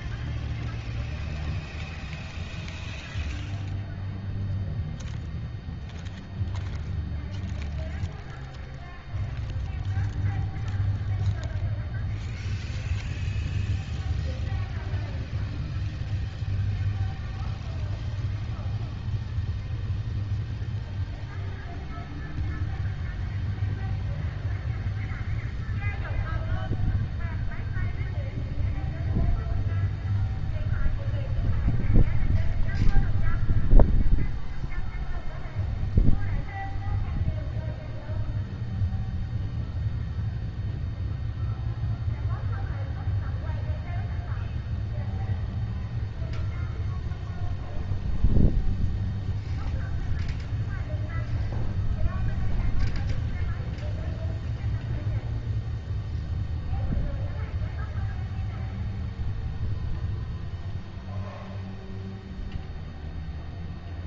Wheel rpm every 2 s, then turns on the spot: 0, 0, 0, 0, 0, 0, 0, 0, 0, 0, 0, 0, 0, 0, 0, 0, 0, 0, 0, 0, 0, 0, 0, 0, 0, 0, 0, 0, 0, 0, 0, 0.
none